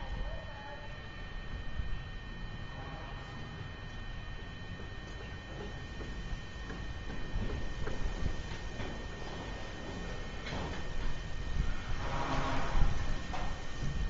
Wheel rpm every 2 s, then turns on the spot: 0, 0, 0, 0, 0, 0, 0.
none